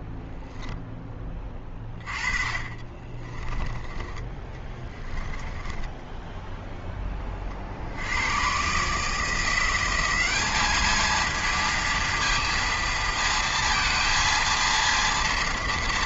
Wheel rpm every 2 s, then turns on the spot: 0, 30, 10, 0, 130, 210, 230, 230.
2-4